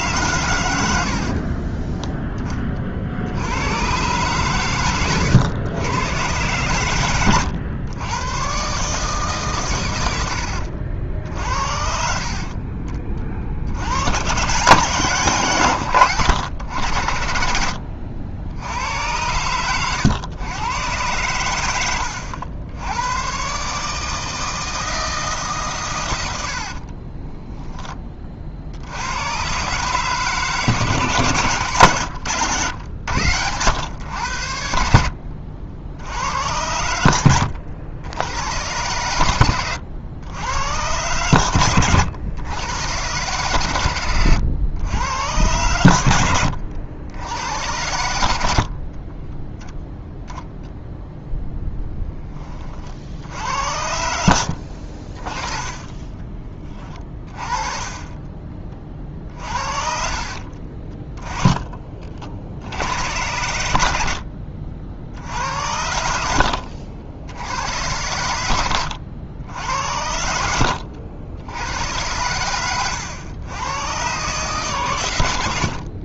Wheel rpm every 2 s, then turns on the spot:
100, 30, 120, 110, 140, 70, 30, 130, 90, 80, 110, 90, 160, 60, 60, 140, 110, 80, 80, 100, 100, 100, 100, 80, 60, 0, 40, 50, 20, 30, 30, 70, 50, 70, 90, 80, 110, 130.
26-28 60-62